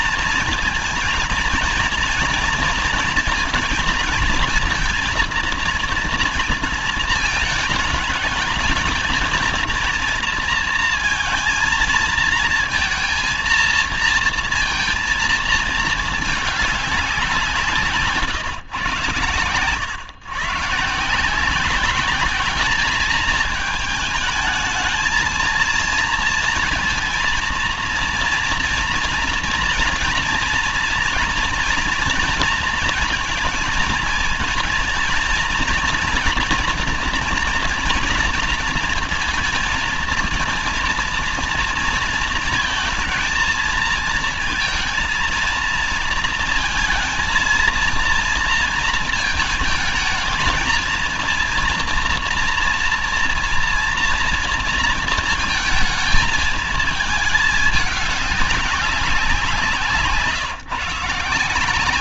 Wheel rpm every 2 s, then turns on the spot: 220, 230, 230, 230, 220, 230, 220, 230, 210, 140, 130, 200, 220, 230, 230, 230, 230, 220, 240, 230, 230, 230, 230, 230, 230, 220, 230, 230, 220, 200, 150.
none